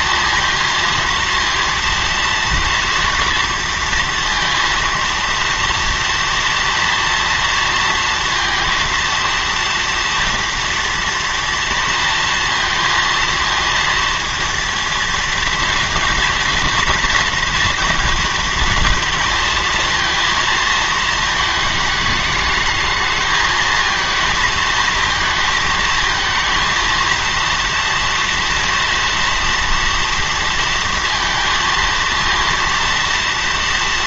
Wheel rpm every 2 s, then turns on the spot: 230, 230, 230, 230, 230, 240, 230, 230, 230, 230, 220, 210, 220, 230, 230, 230, 230.
none